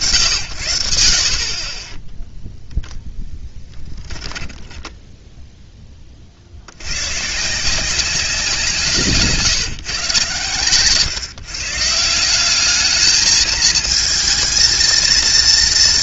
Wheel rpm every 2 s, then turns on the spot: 60, 10, 0, 150, 150, 150, 220, 230.
none